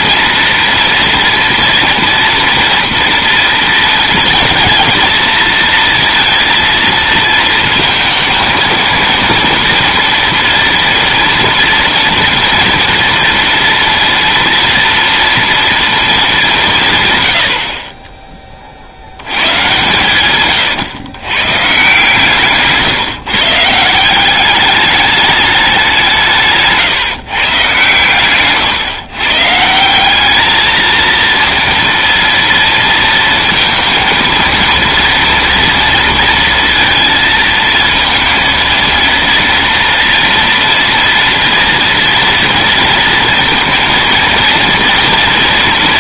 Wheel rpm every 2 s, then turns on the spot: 240, 230, 230, 230, 220, 230, 230, 230, 180, 40, 120, 160, 200, 140, 130, 220, 230, 230, 230, 230, 230, 230, 230.
22-24